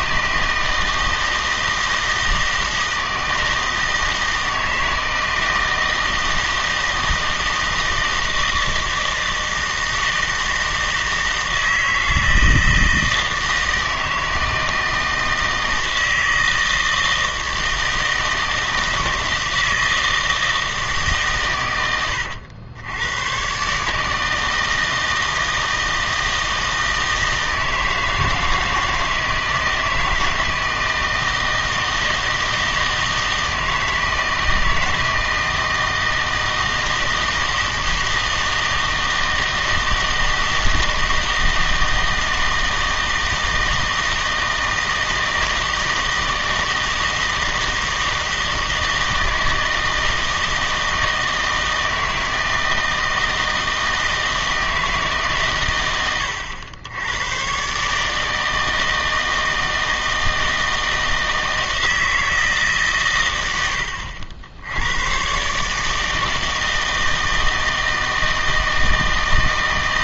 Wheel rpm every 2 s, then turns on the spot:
160, 160, 160, 160, 160, 160, 160, 160, 160, 160, 160, 90, 160, 160, 160, 160, 160, 160, 160, 160, 160, 160, 160, 160, 160, 160, 160, 160, 90, 160, 160, 150, 80, 160, 160.
none